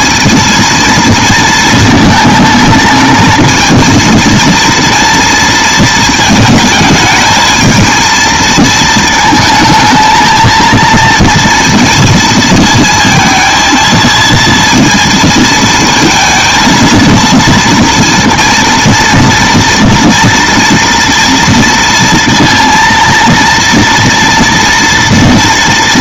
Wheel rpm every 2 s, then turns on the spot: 230, 220, 230, 220, 220, 220, 220, 230, 230, 230, 230, 230, 230.
none